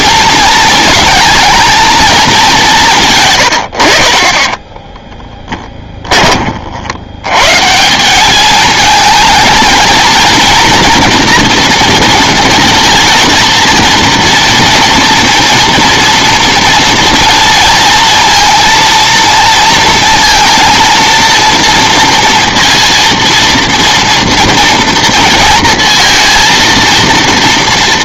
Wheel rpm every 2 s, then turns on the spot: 220, 190, 20, 40, 210, 230, 230, 230, 230, 230, 230, 230, 230, 230.
4-6